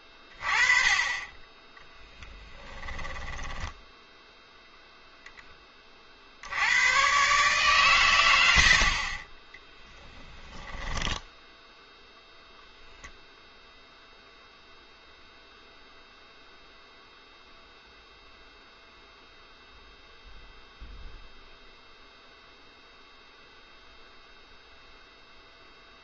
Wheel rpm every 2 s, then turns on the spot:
20, 10, 0, 80, 80, 10, 0, 0, 0, 0, 0, 0, 0.
2-4 8-12